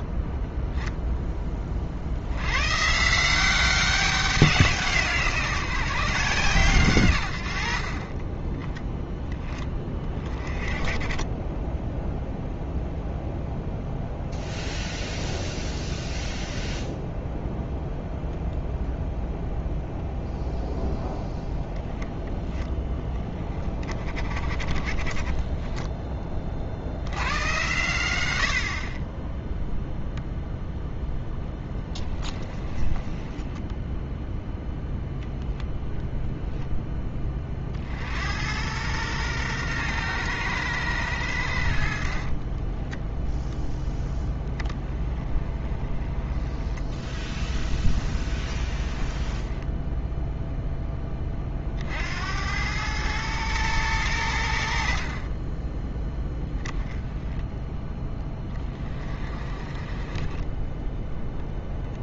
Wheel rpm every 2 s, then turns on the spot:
10, 140, 180, 130, 10, 20, 0, 0, 0, 0, 0, 10, 40, 70, 40, 0, 20, 0, 10, 110, 100, 10, 10, 10, 20, 10, 100, 60, 10, 20, 10.
32-34 48-50 60-62